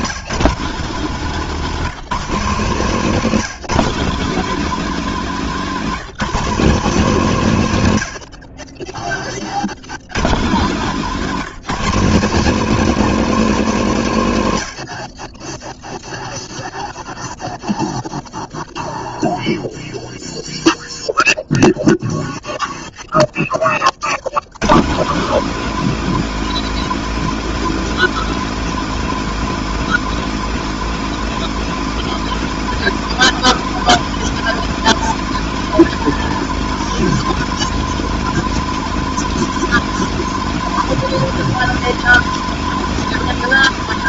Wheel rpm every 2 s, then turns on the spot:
170, 170, 210, 180, 20, 170, 220, 40, 0, 0, 0, 0, 170, 230, 230, 230, 230, 230, 220, 220, 220, 220.
none